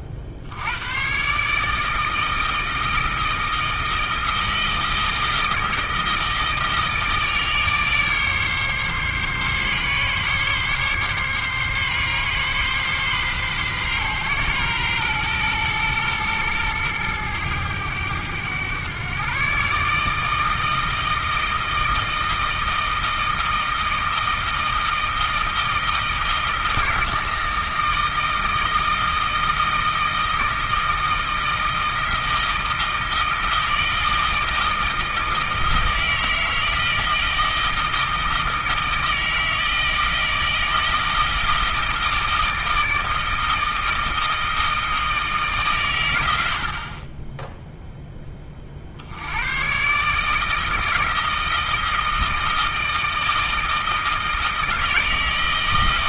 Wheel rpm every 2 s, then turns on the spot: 100, 160, 160, 160, 140, 140, 130, 120, 110, 120, 160, 160, 160, 160, 160, 160, 160, 160, 160, 160, 160, 160, 160, 50, 60, 160, 160, 160.
none